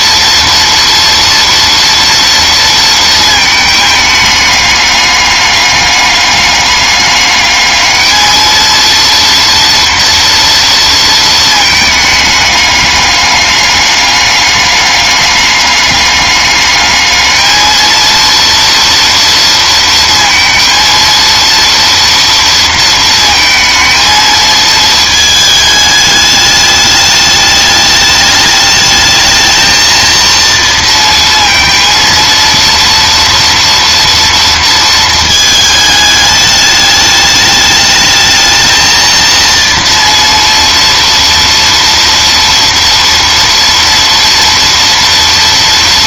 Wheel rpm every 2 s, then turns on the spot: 230, 230, 210, 200, 230, 230, 210, 210, 210, 230, 230, 230, 220, 210, 210, 230, 230, 230, 210, 220, 230, 230, 230.
none